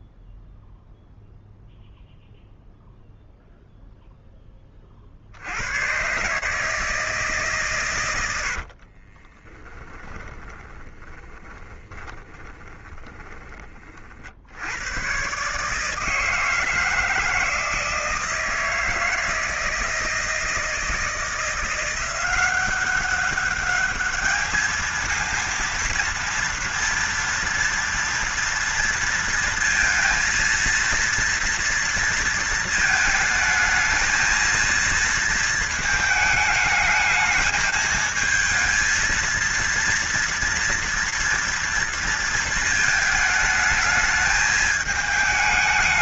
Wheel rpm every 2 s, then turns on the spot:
0, 0, 50, 160, 40, 20, 20, 120, 160, 160, 160, 190, 230, 230, 230, 230, 220, 230, 220, 230, 230, 220, 220.
8-14